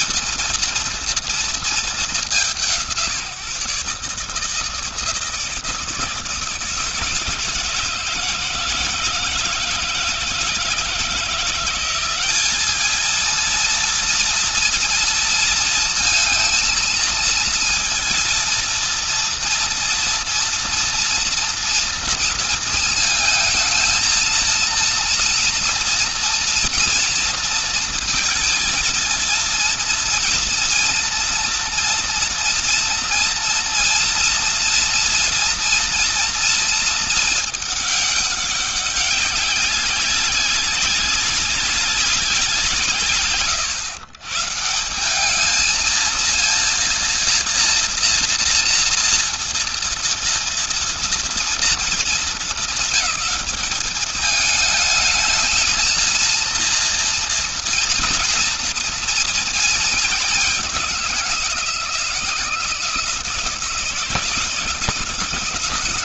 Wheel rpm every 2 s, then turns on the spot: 160, 180, 140, 160, 160, 160, 190, 230, 220, 230, 230, 230, 220, 230, 230, 230, 240, 230, 230, 210, 190, 180, 130, 230, 230, 230, 220, 210, 230, 230, 210, 170, 170.
none